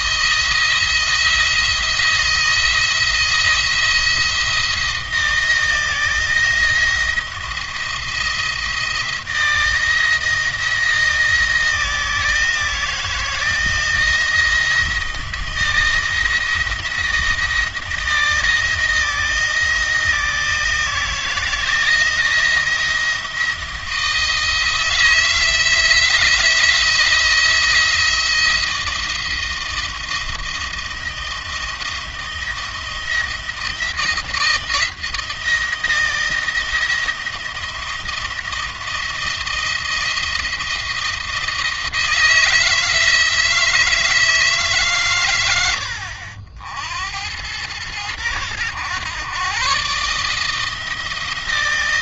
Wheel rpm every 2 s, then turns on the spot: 170, 170, 160, 160, 160, 160, 160, 170, 170, 160, 160, 170, 160, 170, 170, 170, 170, 170, 170, 170, 170, 160, 140, 70, 100, 160.
none